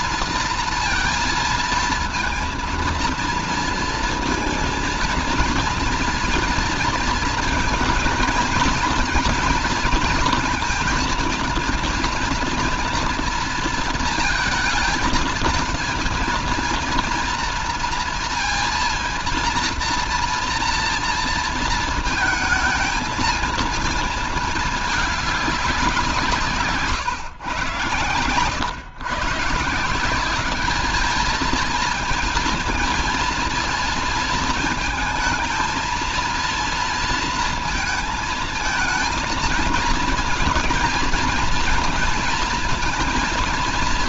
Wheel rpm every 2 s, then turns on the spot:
230, 230, 230, 230, 230, 230, 230, 220, 230, 230, 230, 230, 220, 160, 120, 190, 230, 220, 230, 220, 230, 230.
none